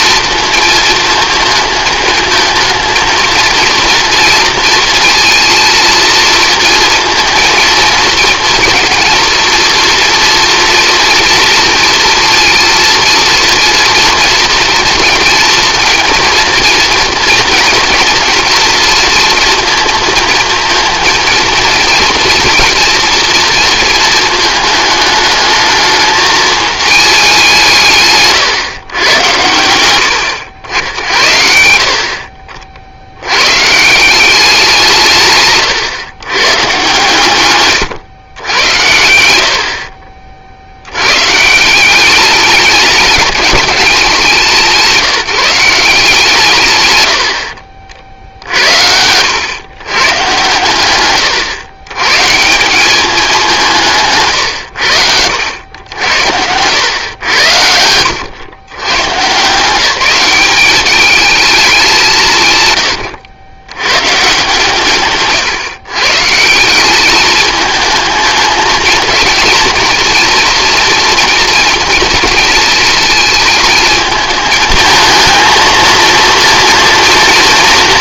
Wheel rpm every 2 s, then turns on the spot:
230, 220, 230, 230, 230, 230, 230, 230, 230, 230, 220, 230, 210, 220, 120, 80, 50, 170, 130, 100, 60, 200, 180, 130, 70, 120, 180, 90, 100, 120, 190, 130, 140, 170, 220, 240, 220, 220, 230.
none